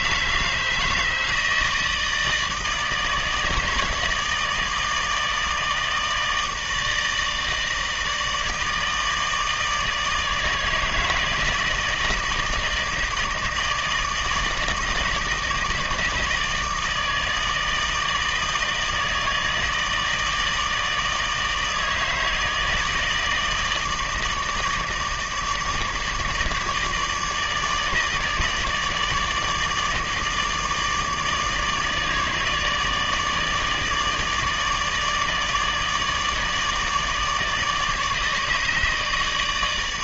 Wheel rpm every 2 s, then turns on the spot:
160, 160, 160, 160, 160, 160, 160, 150, 160, 160, 160, 160, 160, 160, 150, 160, 150, 150, 160, 160.
none